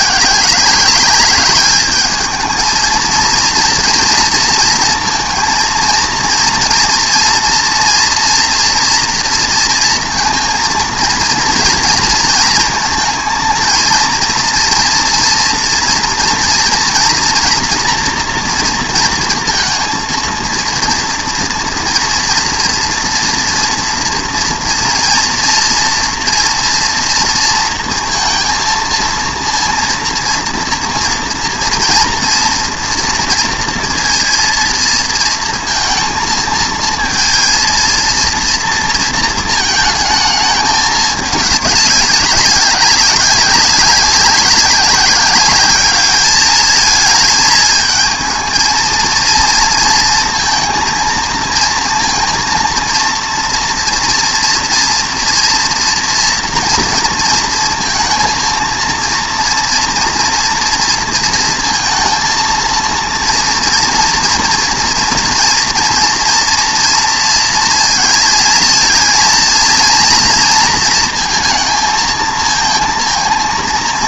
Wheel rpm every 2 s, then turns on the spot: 190, 220, 230, 230, 240, 230, 220, 230, 230, 230, 230, 230, 230, 230, 230, 230, 230, 230, 230, 230, 210, 190, 190, 220, 220, 230, 230, 230, 230, 230, 230, 230, 230, 230, 230, 230, 220.
none